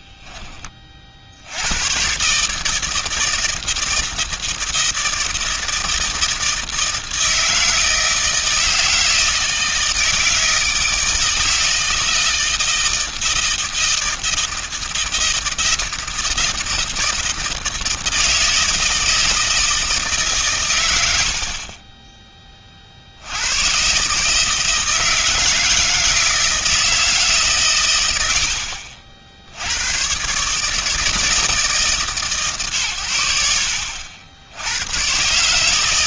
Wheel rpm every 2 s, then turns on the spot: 20, 140, 160, 160, 160, 160, 160, 160, 160, 160, 140, 20, 160, 160, 80, 140, 130, 90.
none